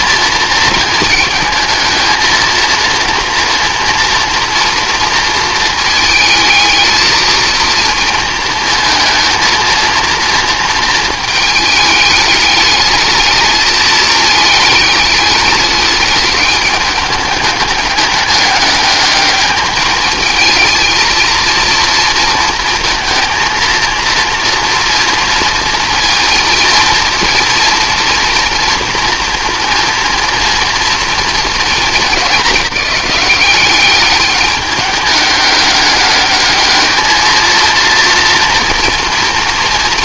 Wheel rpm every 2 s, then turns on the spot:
230, 230, 230, 220, 230, 220, 210, 210, 210, 210, 220, 230, 240, 230, 230, 230, 210, 210, 210, 230.
none